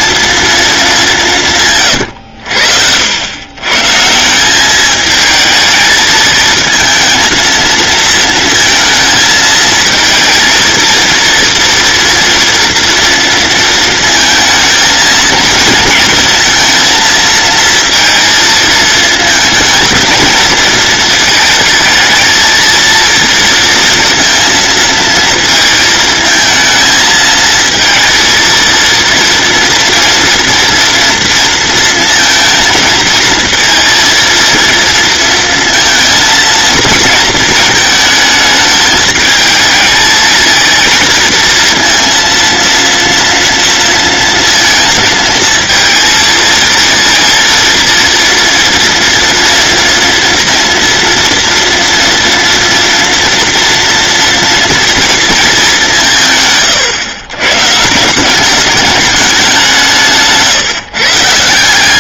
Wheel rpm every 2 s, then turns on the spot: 200, 80, 210, 230, 230, 230, 230, 230, 230, 220, 220, 230, 230, 220, 230, 230, 230, 230, 230, 210, 230, 230, 230, 230, 230, 230, 230, 230, 130, 210, 150.
none